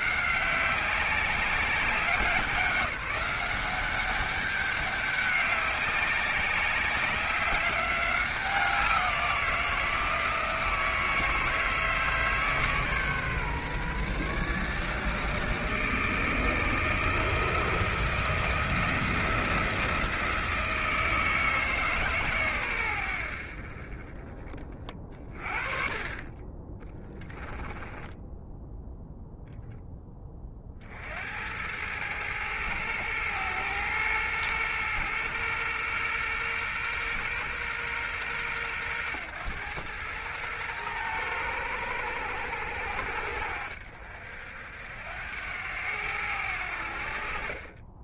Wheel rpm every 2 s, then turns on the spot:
190, 190, 200, 190, 180, 160, 140, 150, 160, 170, 160, 90, 30, 10, 0, 50, 110, 120, 120, 110, 110, 80, 80, 60.
26-28